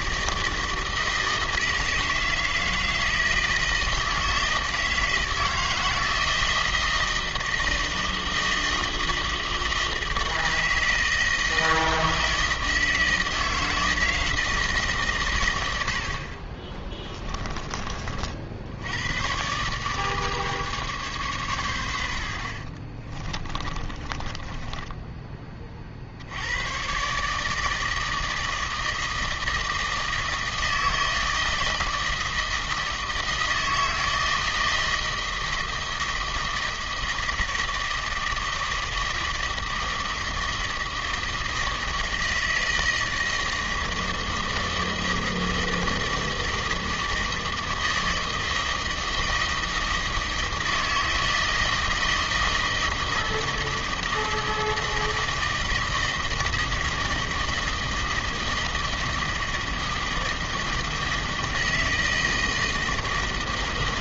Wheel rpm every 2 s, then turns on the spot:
160, 170, 160, 160, 160, 160, 160, 120, 20, 110, 130, 40, 10, 130, 160, 160, 160, 160, 160, 160, 160, 160, 160, 160, 160, 160, 160, 160, 160, 160, 160, 160.
16-18 22-26